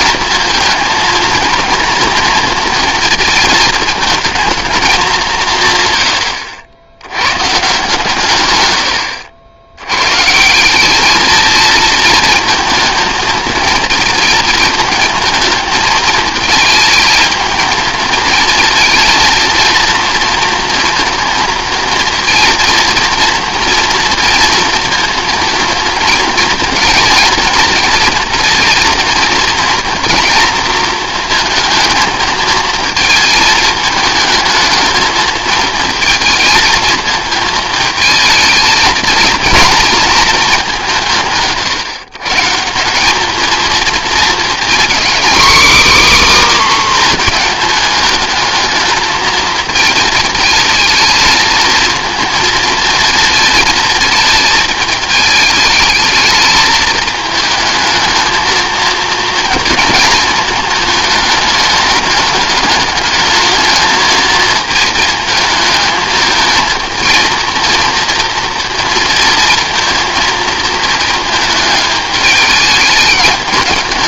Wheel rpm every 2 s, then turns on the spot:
220, 230, 220, 90, 110, 170, 220, 220, 220, 220, 230, 230, 230, 230, 230, 230, 220, 220, 230, 220, 210, 150, 230, 280, 220, 220, 230, 220, 220, 220, 220, 210, 220, 220, 230, 230, 210.
none